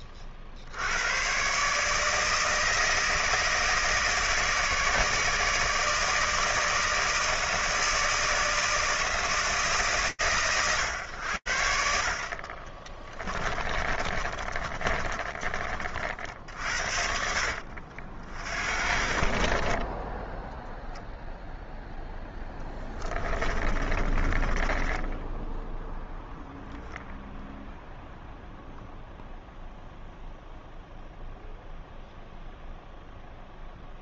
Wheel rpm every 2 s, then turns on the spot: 40, 160, 160, 160, 160, 110, 40, 30, 70, 60, 10, 10, 20, 0, 0, 0, 0.
14-16 22-26